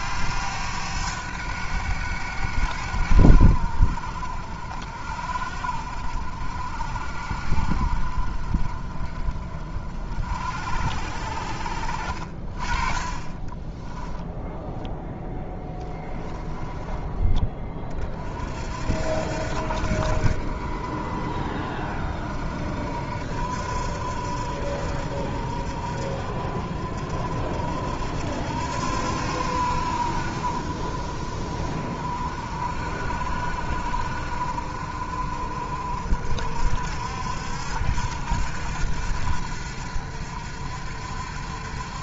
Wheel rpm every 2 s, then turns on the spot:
100, 80, 70, 60, 40, 60, 30, 0, 10, 60, 50, 60, 60, 50, 80, 50, 50, 50, 60, 80, 70.
12-14 16-18